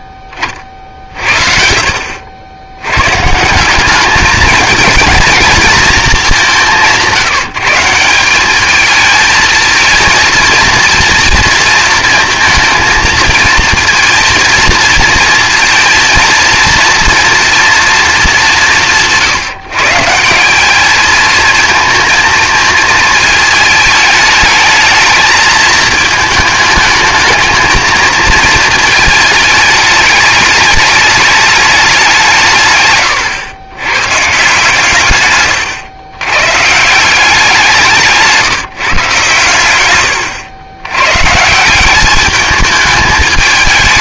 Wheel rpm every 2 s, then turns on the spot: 30, 90, 220, 190, 200, 230, 230, 230, 230, 160, 200, 220, 220, 220, 220, 210, 150, 150, 140, 160, 100, 210.
32-34